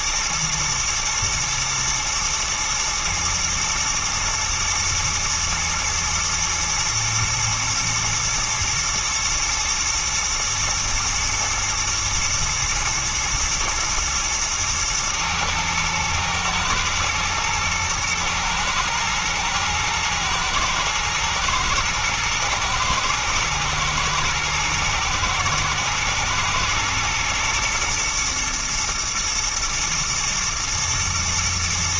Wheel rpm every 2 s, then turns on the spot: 110, 110, 120, 110, 120, 120, 110, 120, 110, 110, 110, 110, 110, 120, 120, 110.
none